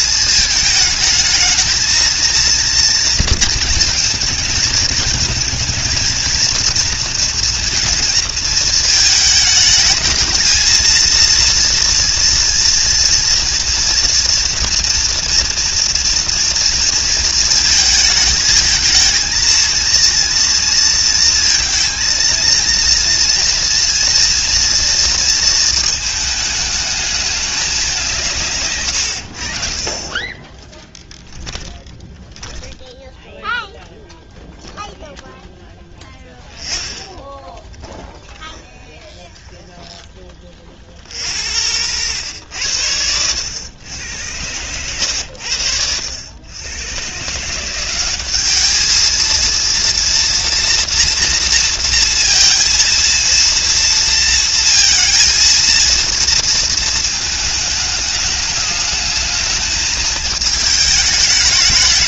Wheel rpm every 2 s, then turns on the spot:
220, 230, 220, 230, 220, 230, 230, 230, 230, 230, 230, 230, 230, 210, 110, 20, 10, 0, 10, 20, 40, 90, 100, 120, 220, 230, 230, 230, 220, 210, 210.
30-34 36-40